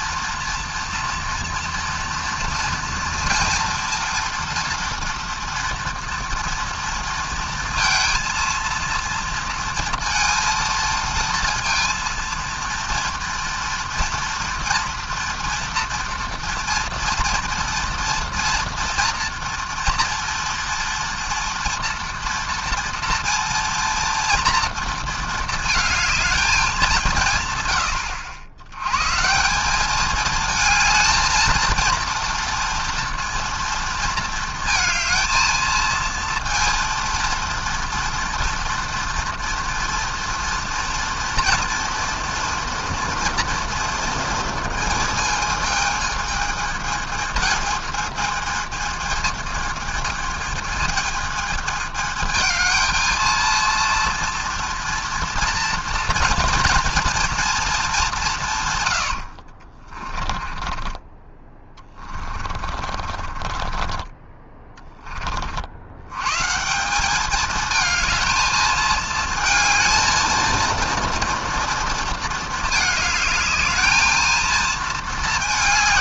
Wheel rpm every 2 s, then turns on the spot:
240, 230, 230, 230, 230, 230, 230, 240, 230, 230, 230, 230, 230, 190, 120, 220, 230, 220, 230, 230, 230, 240, 230, 220, 220, 220, 220, 230, 230, 120, 20, 40, 20, 170, 220, 230, 220, 220.
60-64